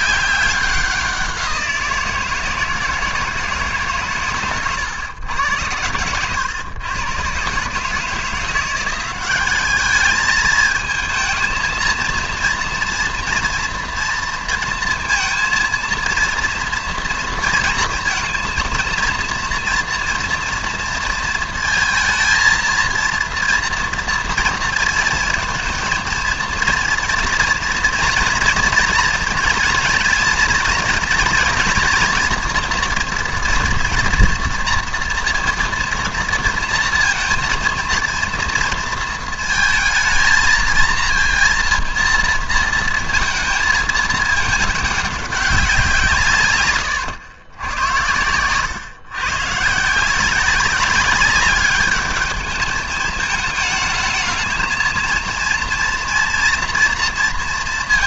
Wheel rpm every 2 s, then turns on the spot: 190, 160, 130, 110, 170, 220, 230, 230, 230, 230, 230, 230, 230, 230, 230, 230, 230, 230, 230, 230, 230, 220, 210, 140, 120, 190, 210, 230, 230.
none